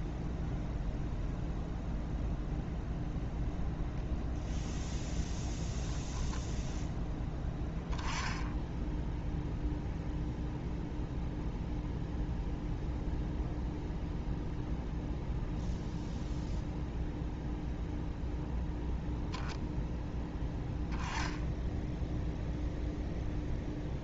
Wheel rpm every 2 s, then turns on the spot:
0, 0, 0, 10, 10, 0, 0, 0, 0, 0, 10, 0.
none